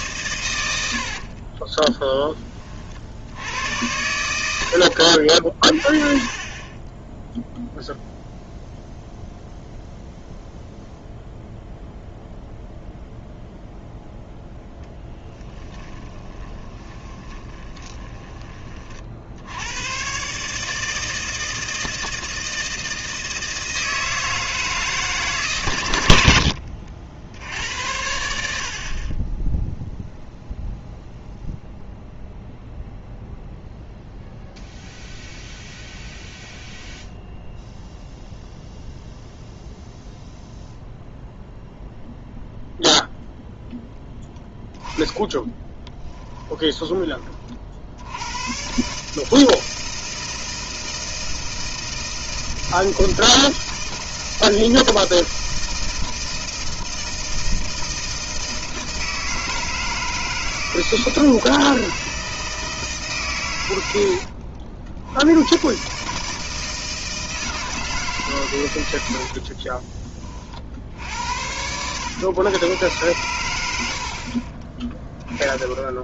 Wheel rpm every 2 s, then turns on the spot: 90, 30, 80, 30, 0, 0, 0, 0, 20, 30, 150, 160, 160, 70, 60, 0, 0, 0, 0, 0, 0, 0, 20, 10, 110, 160, 160, 160, 160, 160, 160, 160, 50, 160, 110, 50, 120, 30.
16-18 26-28 46-48